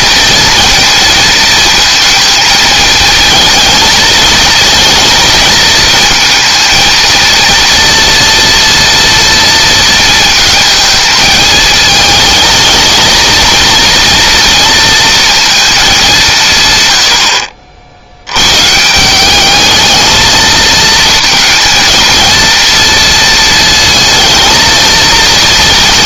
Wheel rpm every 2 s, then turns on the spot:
230, 220, 230, 230, 230, 220, 220, 230, 120, 150, 230, 230, 230.
none